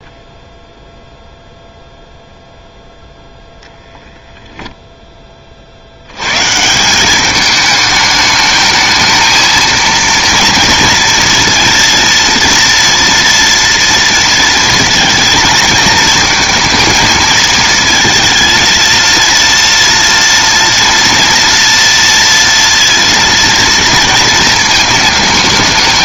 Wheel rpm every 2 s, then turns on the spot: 0, 0, 0, 160, 220, 230, 230, 230, 230, 230, 230, 230, 220.
none